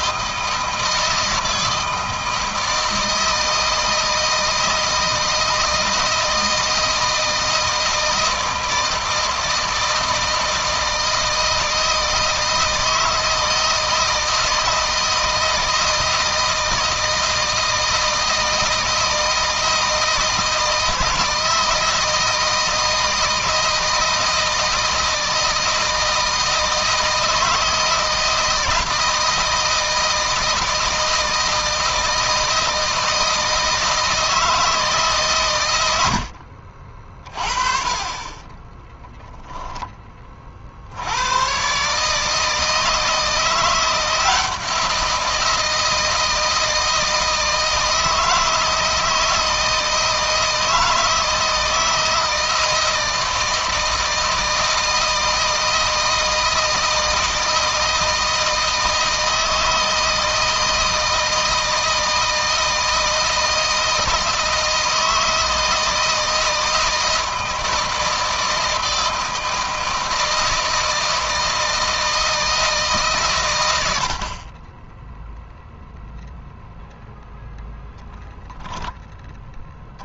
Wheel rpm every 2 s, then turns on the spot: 160, 160, 160, 160, 160, 160, 160, 160, 160, 160, 160, 160, 160, 160, 170, 160, 160, 150, 50, 10, 60, 160, 170, 160, 160, 160, 160, 160, 160, 160, 160, 160, 160, 160, 160, 160, 140, 10, 0, 10.
38-40